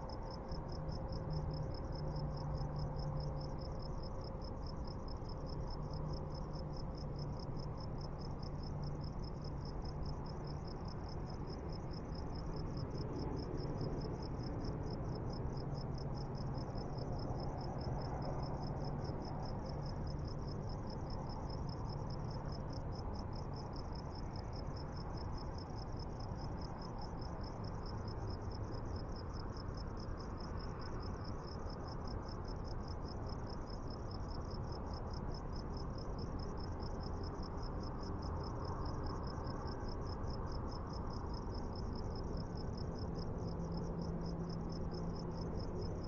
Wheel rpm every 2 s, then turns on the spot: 0, 0, 0, 0, 0, 0, 0, 0, 0, 0, 0, 0, 0, 0, 0, 0, 0, 0, 0, 0, 0, 0, 0.
none